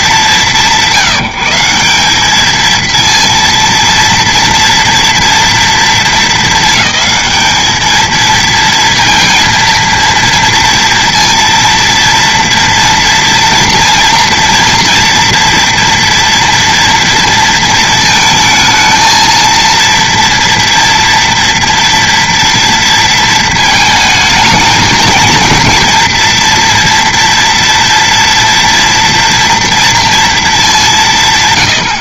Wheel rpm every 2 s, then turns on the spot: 170, 230, 230, 220, 230, 230, 230, 240, 230, 230, 230, 230, 220, 230, 230, 120.
none